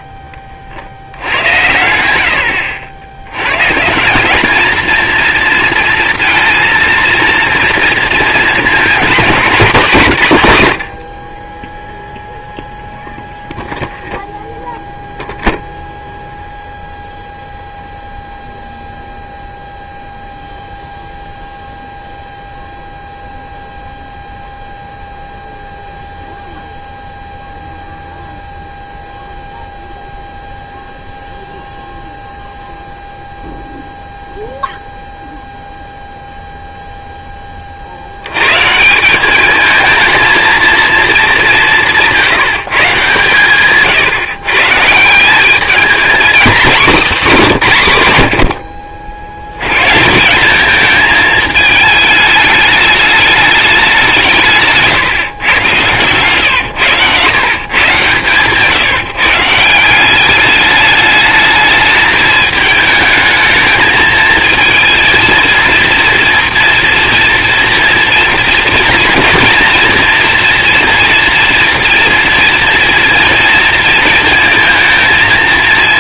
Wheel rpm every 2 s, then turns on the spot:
80, 230, 230, 230, 120, 0, 0, 0, 0, 0, 0, 0, 0, 0, 0, 0, 0, 0, 60, 220, 180, 140, 230, 130, 140, 220, 200, 120, 130, 170, 210, 220, 230, 230, 230, 230, 230, 230.
none